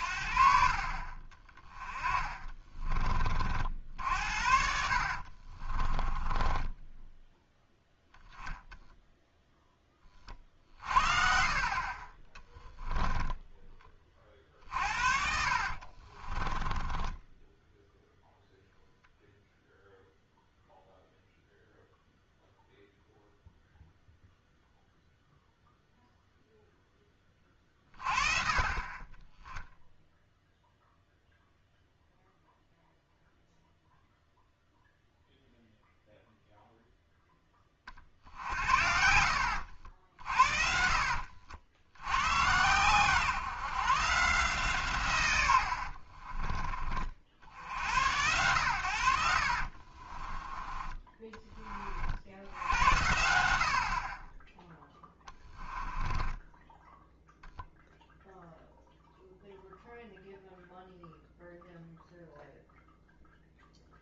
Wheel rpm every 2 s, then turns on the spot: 50, 30, 70, 20, 0, 50, 10, 50, 20, 0, 0, 0, 0, 10, 30, 0, 0, 0, 0, 70, 50, 120, 130, 30, 100, 20, 80, 10, 10, 0, 0, 0.
2-8 14-18 54-58